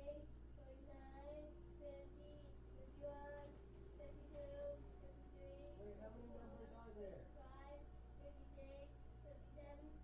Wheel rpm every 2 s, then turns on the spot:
0, 0, 0, 0, 0.
none